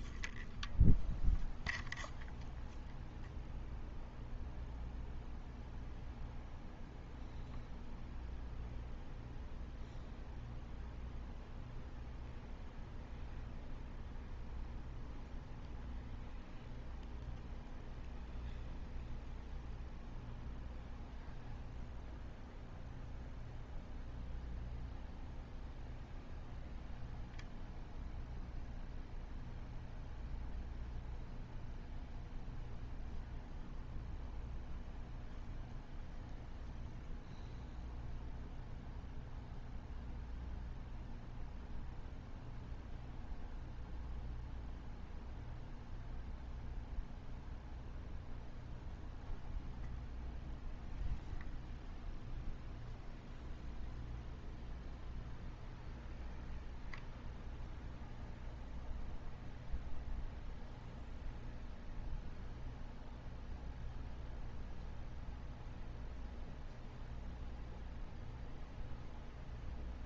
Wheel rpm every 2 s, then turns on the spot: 0, 0, 0, 0, 0, 0, 0, 0, 0, 0, 0, 0, 0, 0, 0, 0, 0, 0, 0, 0, 0, 0, 0, 0, 0, 0, 0, 0, 0, 0, 0, 0, 0, 0, 0.
none